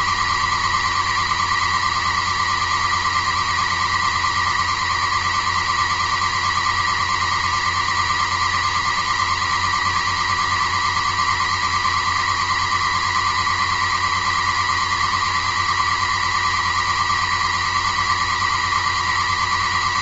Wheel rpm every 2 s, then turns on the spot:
140, 140, 140, 130, 130, 140, 130, 140, 130, 140.
none